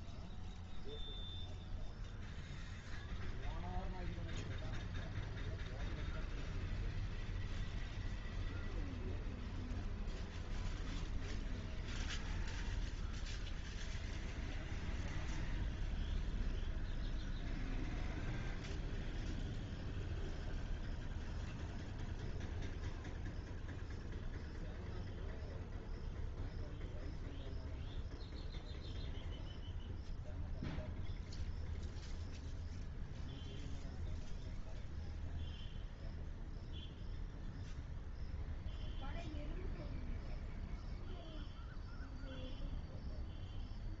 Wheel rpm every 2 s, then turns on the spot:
0, 0, 0, 0, 0, 0, 0, 0, 0, 0, 0, 0, 0, 0, 0, 0, 0, 0, 0, 0, 0, 0.
none